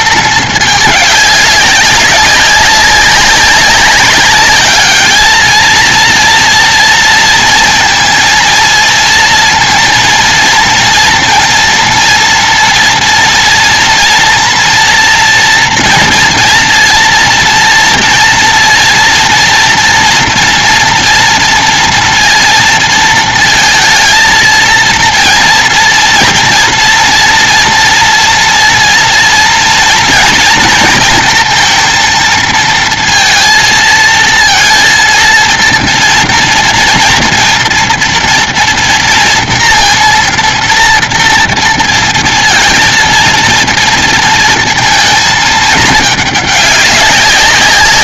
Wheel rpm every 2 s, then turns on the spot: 220, 200, 200, 230, 230, 230, 230, 240, 230, 230, 230, 230, 220, 230, 230, 230, 230, 230, 230, 230, 230, 230, 230, 210.
none